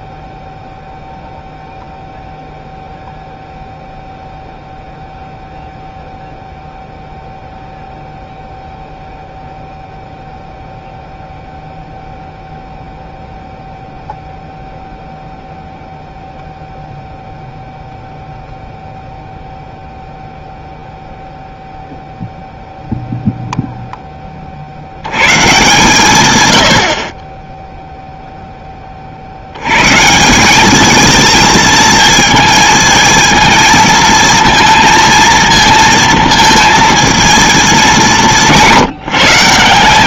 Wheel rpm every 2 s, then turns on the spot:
0, 0, 0, 0, 0, 0, 0, 0, 0, 0, 0, 0, 60, 90, 10, 210, 220, 230, 230, 180.
none